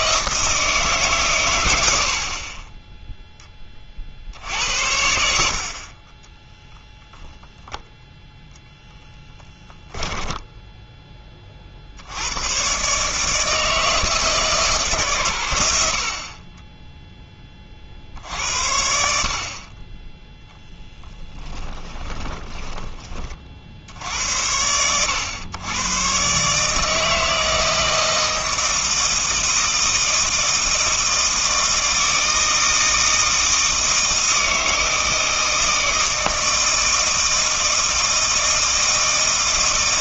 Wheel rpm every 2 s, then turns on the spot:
160, 20, 70, 0, 0, 10, 130, 150, 10, 70, 20, 20, 90, 150, 160, 160, 160, 160, 160, 160.
10-12 20-22